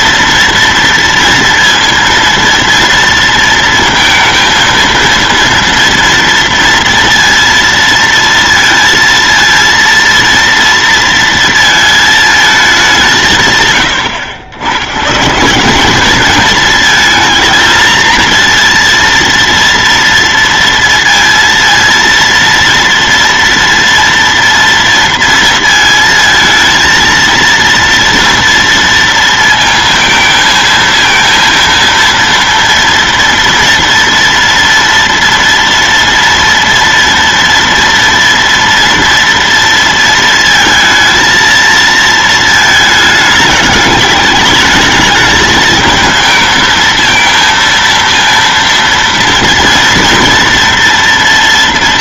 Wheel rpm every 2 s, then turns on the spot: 230, 230, 230, 230, 230, 230, 210, 100, 220, 230, 230, 230, 230, 220, 230, 220, 230, 230, 230, 230, 230, 220, 210, 220, 230, 230.
none